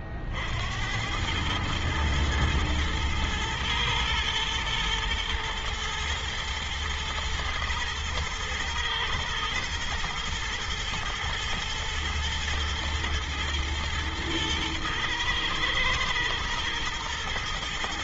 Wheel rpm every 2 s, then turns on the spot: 50, 110, 110, 120, 110, 120, 120, 110, 110.
none